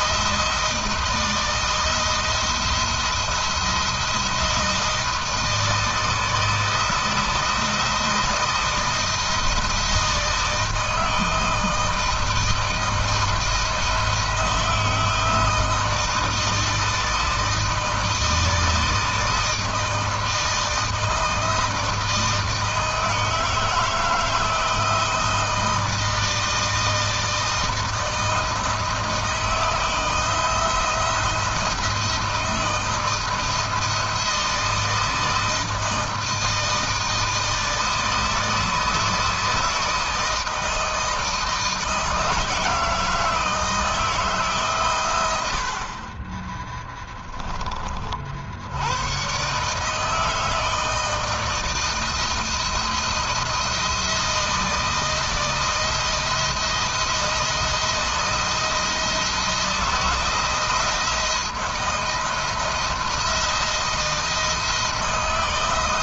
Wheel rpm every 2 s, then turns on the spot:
160, 170, 160, 160, 170, 160, 160, 160, 160, 160, 160, 160, 160, 160, 160, 170, 160, 160, 160, 160, 160, 160, 120, 10, 110, 160, 170, 160, 170, 160, 160, 170, 160.
none